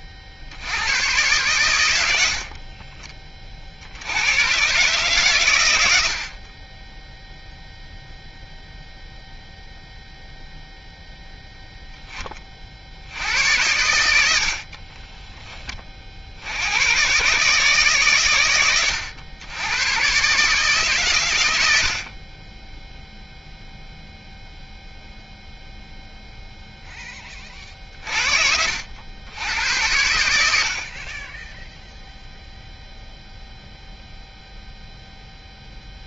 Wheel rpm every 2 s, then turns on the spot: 70, 60, 120, 30, 0, 0, 50, 50, 90, 110, 140, 20, 0, 0, 60, 60, 0, 0.
2-4 14-16